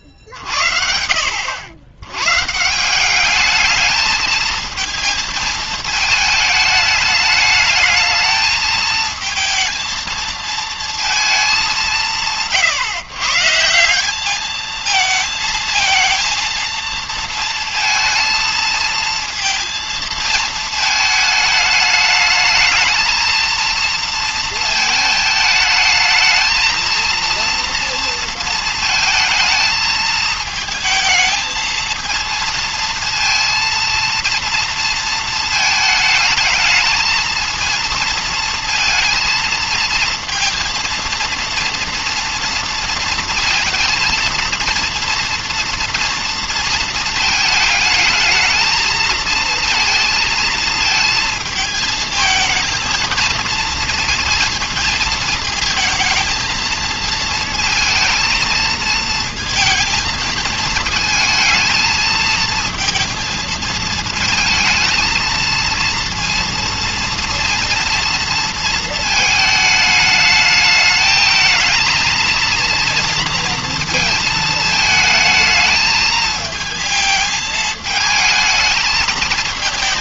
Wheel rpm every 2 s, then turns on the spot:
40, 140, 220, 220, 220, 220, 120, 220, 230, 230, 220, 220, 230, 230, 230, 220, 230, 230, 220, 230, 230, 230, 230, 230, 220, 220, 230, 230, 220, 220, 220, 230, 220, 230, 230, 220, 230, 220, 220, 220.
none